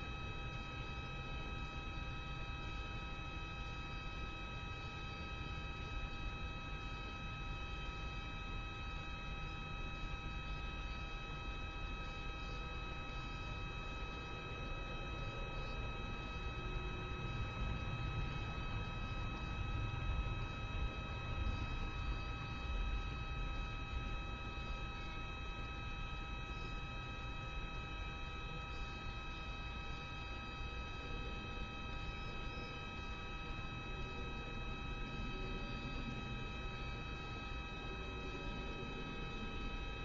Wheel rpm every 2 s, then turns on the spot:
0, 0, 0, 0, 0, 0, 0, 0, 0, 0, 0, 0, 0, 0, 0, 0, 0, 0, 0, 0.
none